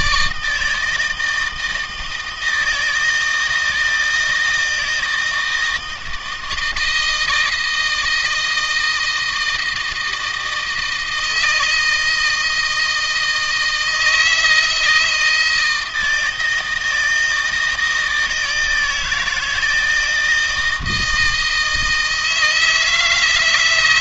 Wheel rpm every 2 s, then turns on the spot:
150, 160, 160, 160, 160, 160, 160, 160, 160, 160, 160, 160.
none